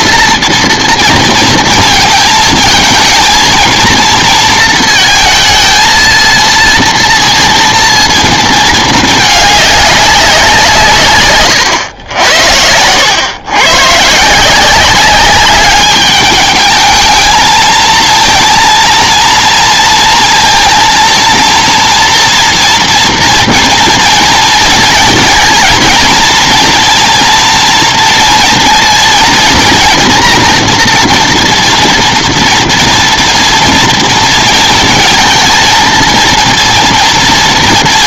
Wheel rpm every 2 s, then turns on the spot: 230, 220, 220, 230, 220, 180, 90, 170, 210, 230, 230, 230, 230, 230, 230, 240, 230, 230, 230.
none